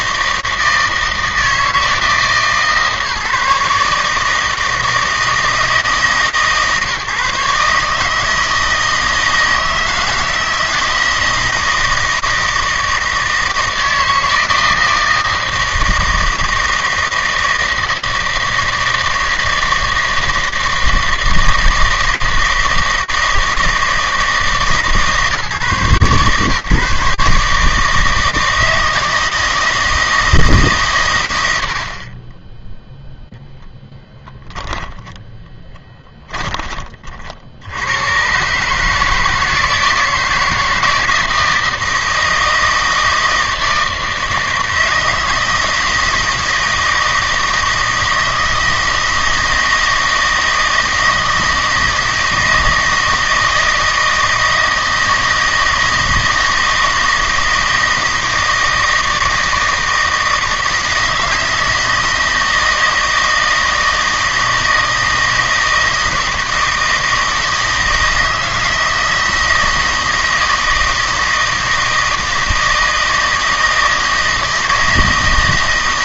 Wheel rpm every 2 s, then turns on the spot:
160, 150, 160, 140, 160, 160, 160, 160, 160, 160, 160, 160, 150, 140, 160, 140, 0, 0, 40, 150, 160, 160, 160, 160, 160, 160, 160, 160, 160, 160, 160, 160, 160, 160, 160, 160, 160, 160.
none